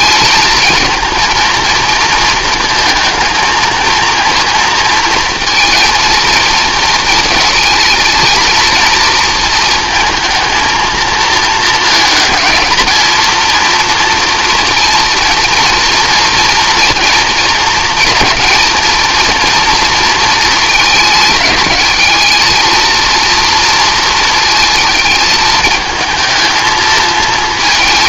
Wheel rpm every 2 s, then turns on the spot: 220, 220, 230, 220, 230, 230, 220, 230, 230, 230, 220, 230, 220, 220.
none